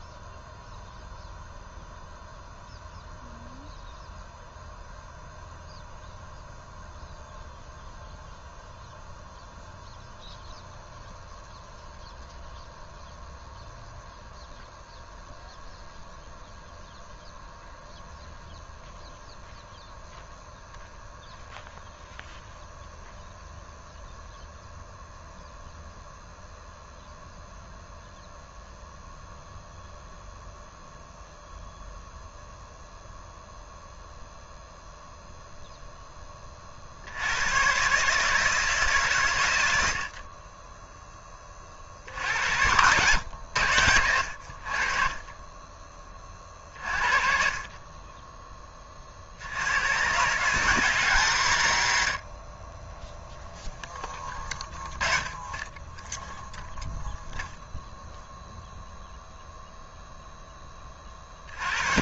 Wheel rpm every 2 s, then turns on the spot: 0, 0, 0, 0, 0, 0, 0, 0, 0, 0, 0, 0, 0, 0, 0, 0, 0, 0, 50, 140, 10, 90, 50, 50, 20, 140, 30, 10, 0, 0, 20.
none